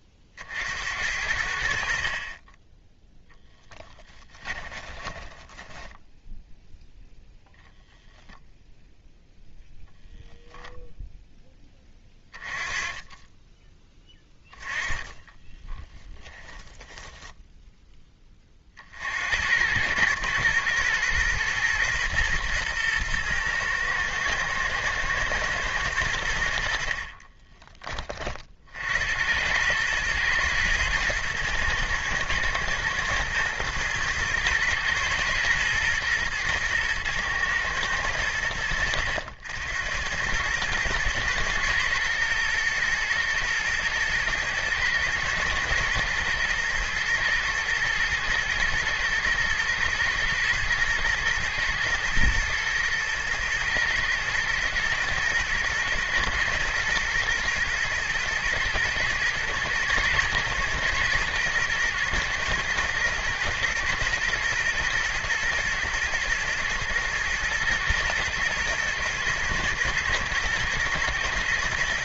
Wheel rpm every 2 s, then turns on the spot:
70, 10, 20, 0, 0, 0, 20, 20, 10, 50, 110, 120, 120, 50, 60, 110, 120, 120, 110, 70, 110, 110, 120, 110, 110, 110, 110, 110, 110, 110, 110, 110, 110, 110, 110, 120.
2-6 14-16